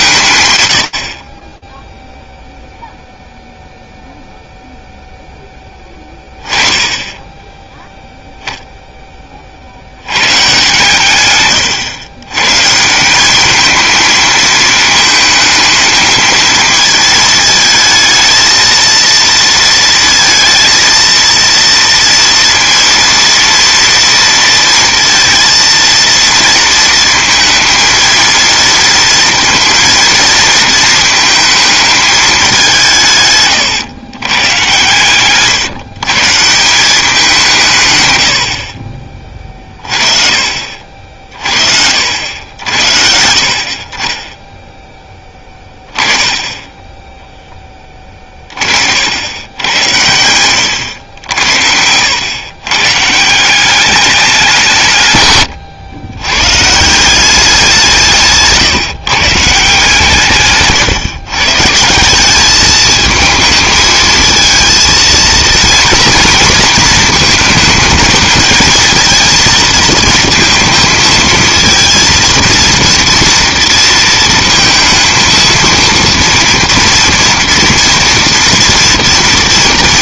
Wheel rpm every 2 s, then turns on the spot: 100, 0, 0, 10, 10, 130, 160, 220, 220, 230, 230, 230, 230, 230, 230, 220, 160, 130, 190, 30, 50, 70, 10, 10, 70, 90, 130, 150, 170, 150, 140, 220, 230, 220, 230, 230, 230, 220, 230, 230.
none